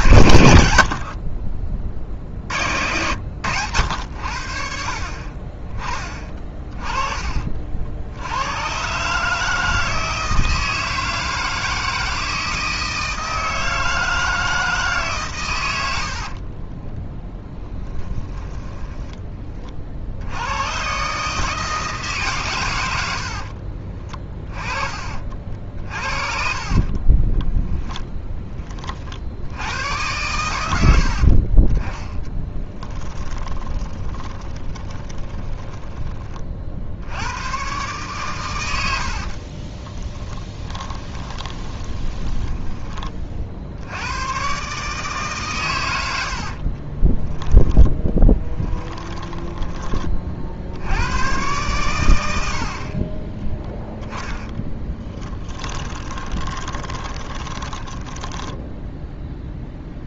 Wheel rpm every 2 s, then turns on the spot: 60, 90, 50, 30, 130, 160, 160, 140, 10, 10, 120, 90, 30, 30, 50, 80, 20, 20, 80, 60, 20, 20, 150, 30, 10, 80, 40, 20, 20, 0.
0-2 16-20 26-28 32-36 38-42 46-50 54-58